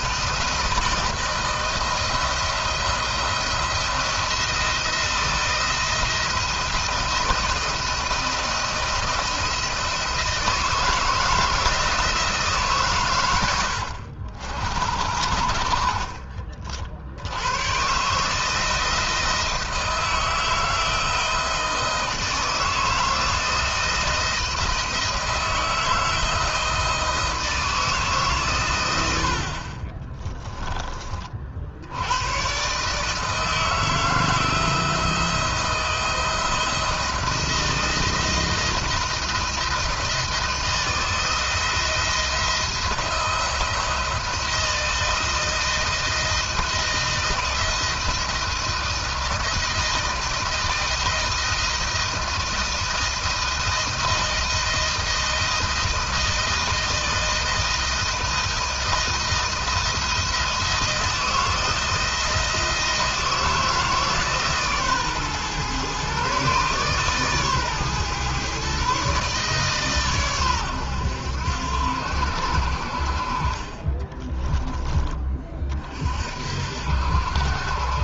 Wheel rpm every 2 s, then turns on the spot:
160, 160, 170, 170, 170, 160, 120, 60, 60, 160, 170, 160, 160, 160, 100, 30, 150, 170, 170, 160, 170, 170, 170, 170, 160, 160, 160, 160, 160, 160, 160, 160, 140, 140, 140, 100, 60, 20, 60.
none